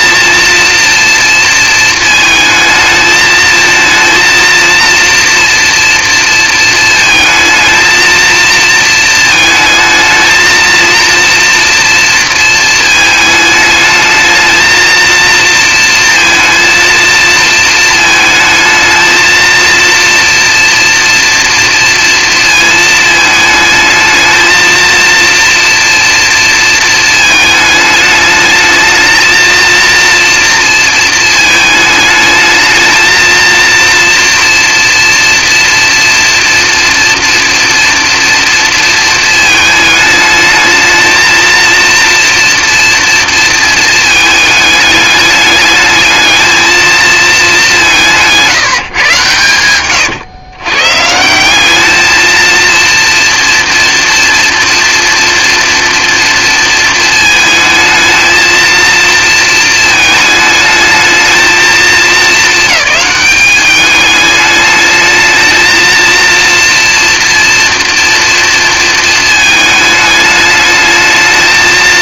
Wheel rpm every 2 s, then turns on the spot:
230, 220, 230, 230, 220, 230, 220, 220, 230, 220, 240, 220, 230, 230, 220, 230, 220, 230, 230, 230, 220, 230, 210, 220, 150, 130, 230, 240, 230, 230, 220, 220, 210, 230, 230, 210.
none